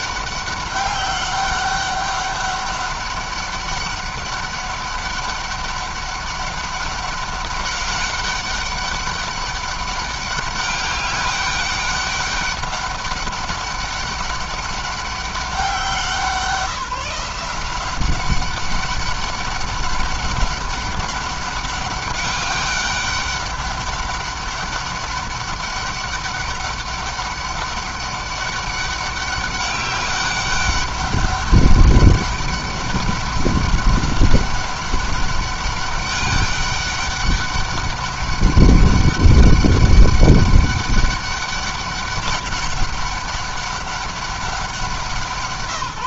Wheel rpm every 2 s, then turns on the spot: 200, 200, 200, 200, 200, 200, 200, 200, 170, 190, 200, 200, 200, 200, 200, 200, 200, 200, 200, 190, 200, 200, 180.
none